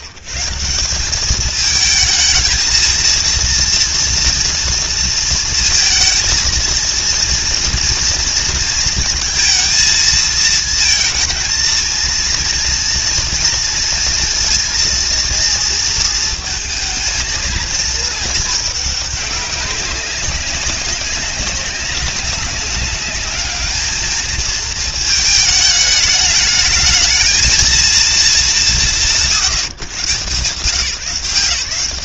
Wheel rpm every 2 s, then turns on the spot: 140, 220, 230, 230, 230, 220, 230, 230, 220, 220, 200, 200, 220, 220, 170, 140.
none